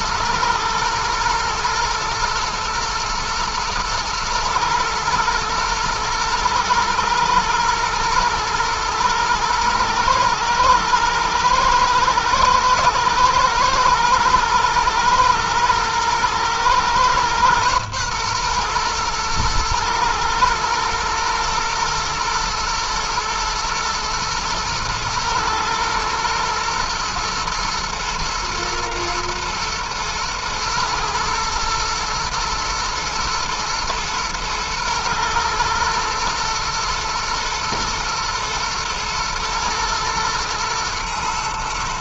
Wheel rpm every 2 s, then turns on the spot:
110, 120, 110, 110, 110, 110, 120, 110, 120, 120, 120, 110, 110, 120, 110, 110, 110, 120, 120, 120, 110.
none